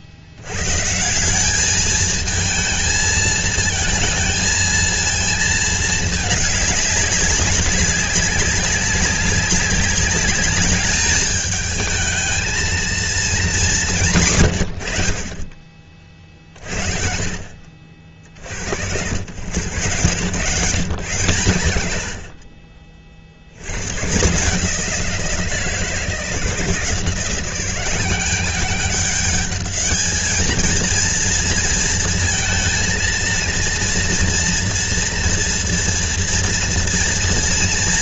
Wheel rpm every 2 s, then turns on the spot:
140, 220, 220, 200, 200, 210, 230, 100, 40, 70, 120, 40, 170, 170, 200, 230, 230, 230, 230.
none